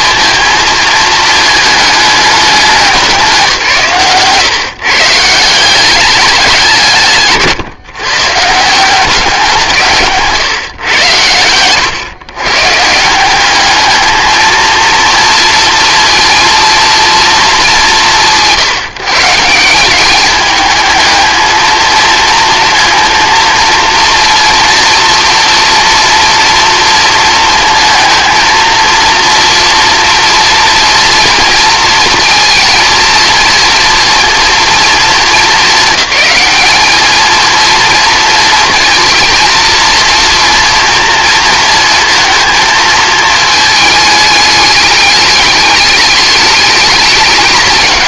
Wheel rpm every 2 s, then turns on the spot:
220, 180, 150, 160, 180, 100, 160, 230, 230, 160, 220, 230, 230, 230, 230, 230, 230, 230, 220, 230, 230, 220, 210, 210.
none